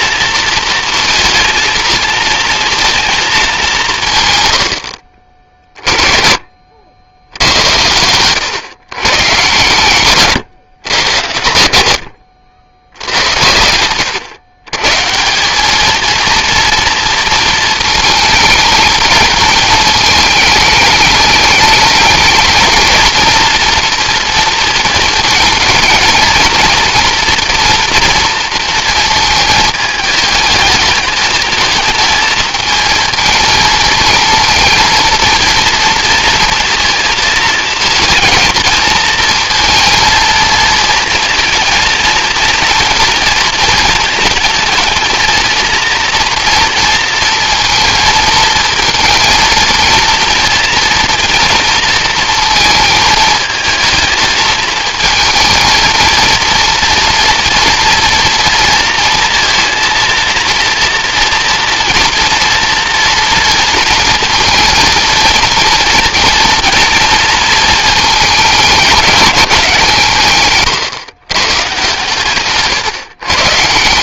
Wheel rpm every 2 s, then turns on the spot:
230, 230, 140, 50, 120, 120, 80, 110, 230, 210, 220, 230, 220, 230, 220, 220, 230, 230, 220, 230, 230, 230, 230, 230, 230, 230, 220, 230, 240, 230, 230, 230, 230, 230, 190, 120, 140.
12-14